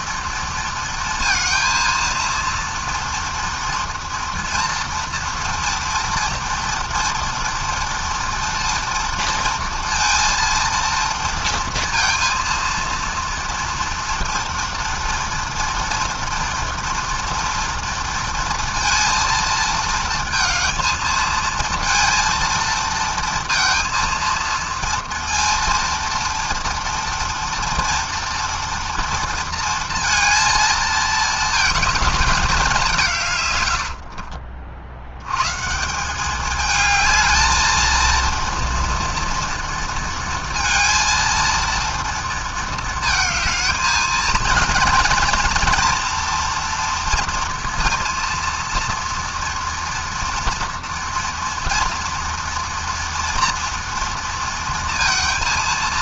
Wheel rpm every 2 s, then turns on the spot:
230, 230, 230, 230, 230, 230, 230, 230, 230, 230, 220, 230, 230, 230, 230, 220, 140, 110, 220, 230, 230, 220, 240, 230, 230, 230, 230, 230.
none